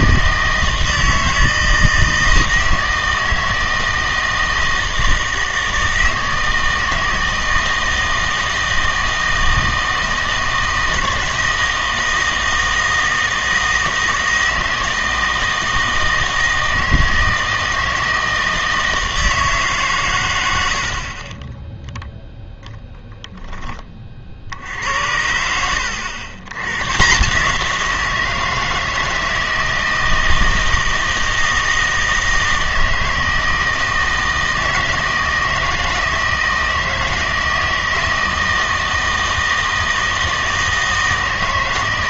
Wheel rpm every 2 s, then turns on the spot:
160, 160, 160, 160, 160, 160, 160, 160, 160, 160, 60, 10, 70, 120, 160, 160, 160, 160, 160, 160, 160.
none